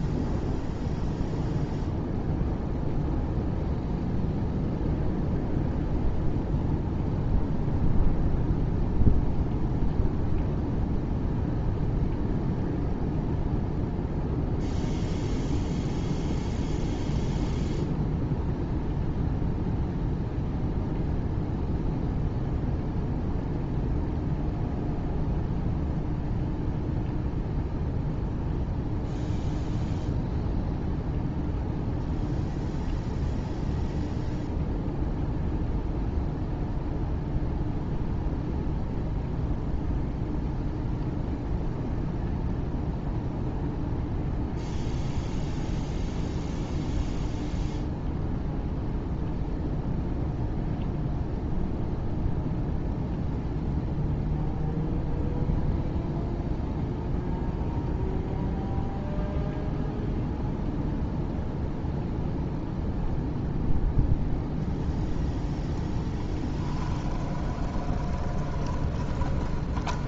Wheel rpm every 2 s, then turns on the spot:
0, 0, 0, 0, 0, 0, 0, 0, 0, 0, 0, 0, 0, 0, 0, 0, 0, 0, 0, 0, 0, 0, 0, 0, 0, 0, 0, 0, 0, 0, 0, 0, 0, 10, 20.
66-70